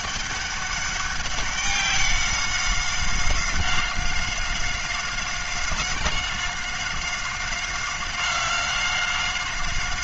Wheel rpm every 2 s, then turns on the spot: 200, 190, 190, 190, 190.
none